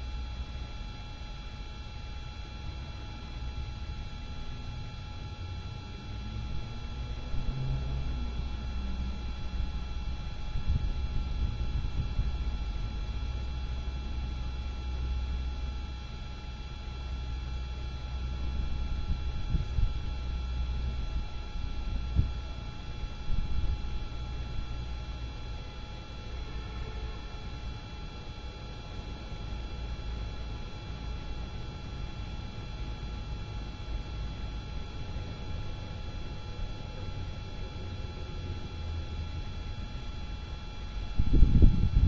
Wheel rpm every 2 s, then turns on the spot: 0, 0, 0, 0, 0, 0, 0, 0, 0, 0, 0, 0, 0, 0, 0, 0, 0, 0, 0, 0, 0.
none